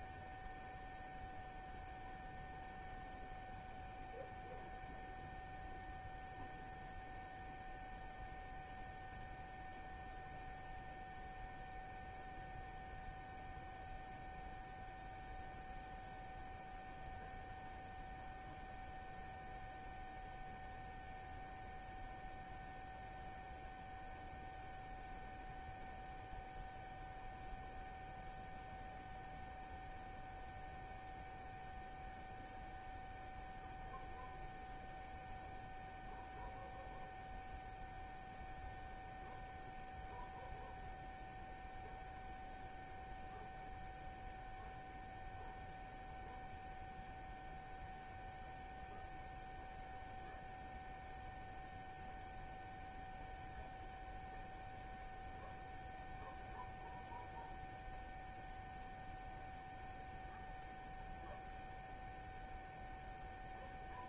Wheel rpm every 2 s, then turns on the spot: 0, 0, 0, 0, 0, 0, 0, 0, 0, 0, 0, 0, 0, 0, 0, 0, 0, 0, 0, 0, 0, 0, 0, 0, 0, 0, 0, 0, 0, 0, 0, 0.
none